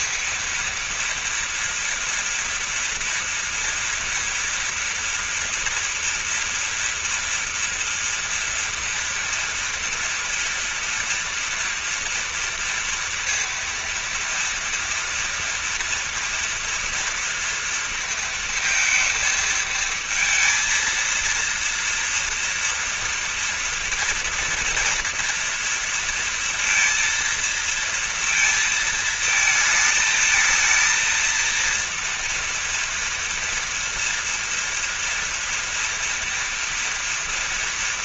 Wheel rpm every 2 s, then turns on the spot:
230, 230, 230, 230, 230, 230, 230, 230, 230, 230, 230, 230, 230, 230, 220, 230, 230, 230, 230.
none